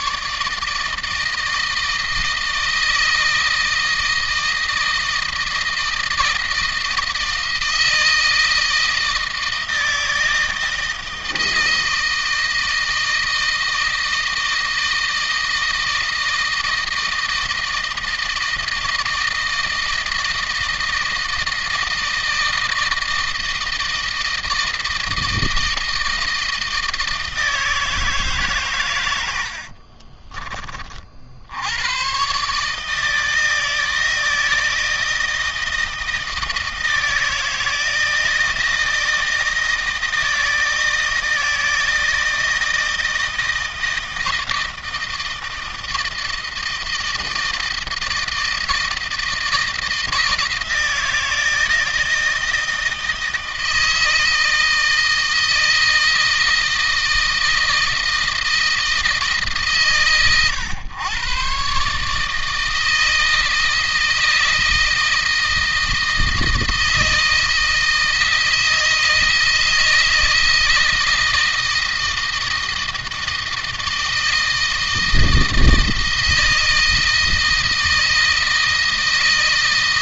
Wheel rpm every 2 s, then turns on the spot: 160, 160, 160, 160, 160, 160, 160, 160, 160, 160, 160, 160, 160, 160, 110, 50, 150, 160, 160, 160, 160, 160, 160, 160, 160, 160, 160, 160, 160, 160, 110, 160, 160, 160, 160, 160, 160, 160, 160, 160.
none